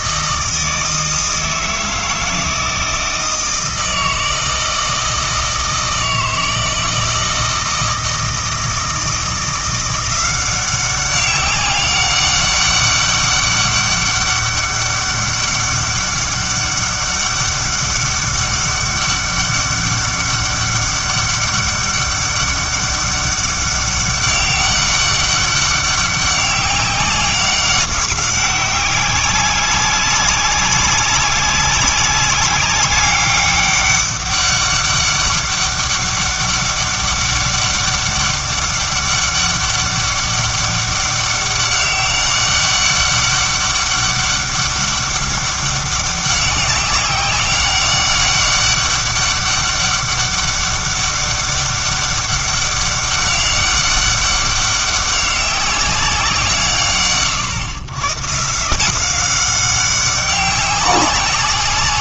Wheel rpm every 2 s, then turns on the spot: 160, 160, 160, 160, 160, 190, 200, 200, 200, 200, 200, 200, 200, 200, 190, 200, 200, 200, 200, 200, 200, 200, 200, 190, 200, 200, 190, 200, 140, 180, 190.
none